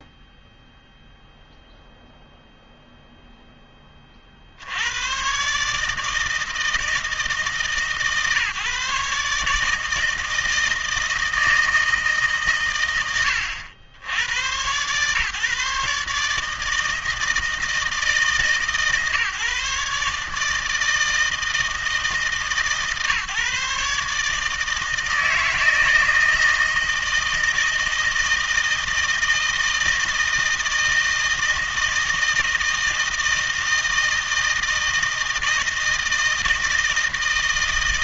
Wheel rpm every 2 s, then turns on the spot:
0, 0, 70, 160, 150, 160, 120, 120, 160, 150, 150, 150, 160, 160, 160, 160, 160, 160, 160.
none